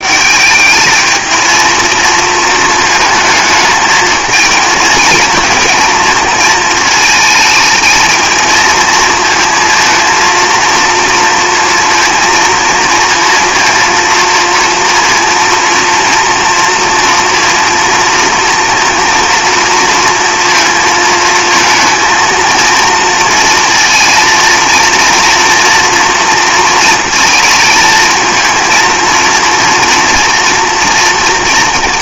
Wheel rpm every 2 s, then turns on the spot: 210, 220, 230, 230, 220, 230, 230, 230, 230, 230, 230, 230, 230, 230, 230, 240.
none